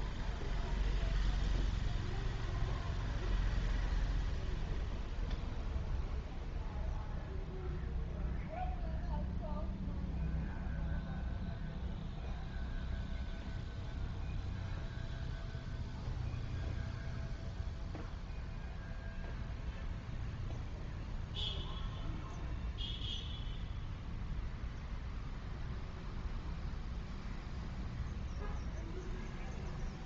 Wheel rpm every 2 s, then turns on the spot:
0, 0, 0, 0, 0, 0, 0, 0, 0, 0, 0, 0, 0, 0, 0.
none